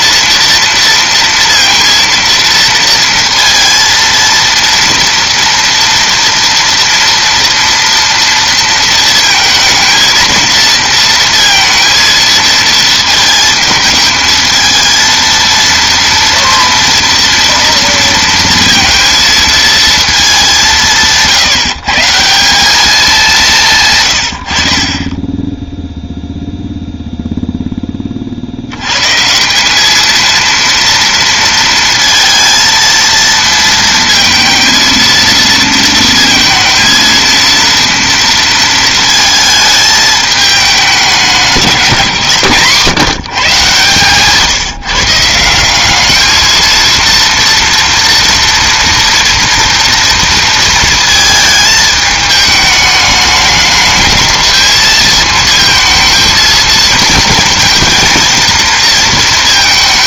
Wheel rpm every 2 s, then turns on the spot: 230, 230, 230, 230, 230, 230, 220, 220, 230, 230, 180, 200, 40, 0, 80, 230, 230, 230, 220, 220, 210, 140, 150, 230, 230, 230, 210, 220, 230, 230.
none